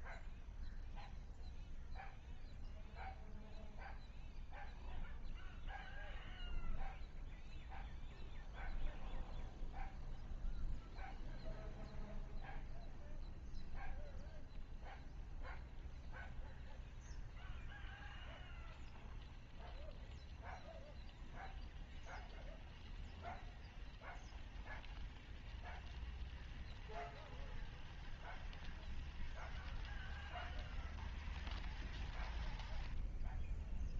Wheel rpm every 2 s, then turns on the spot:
0, 0, 0, 0, 0, 0, 0, 0, 0, 0, 0, 0, 0, 0, 0, 0, 0.
none